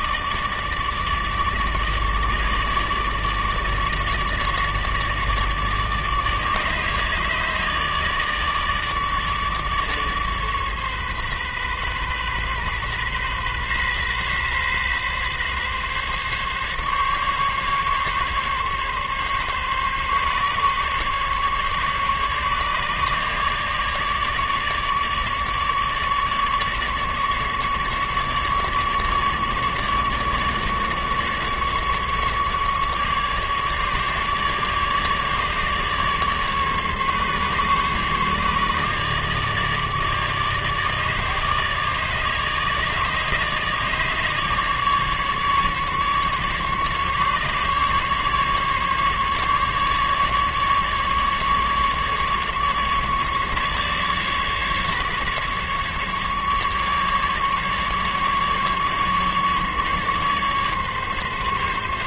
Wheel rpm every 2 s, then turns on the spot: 150, 150, 150, 150, 150, 140, 130, 130, 140, 140, 140, 140, 150, 150, 150, 150, 150, 150, 140, 150, 150, 150, 150, 140, 140, 150, 150, 140, 150, 140, 140.
none